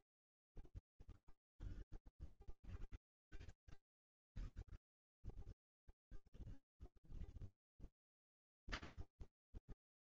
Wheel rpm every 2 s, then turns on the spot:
0, 0, 0, 0, 0.
none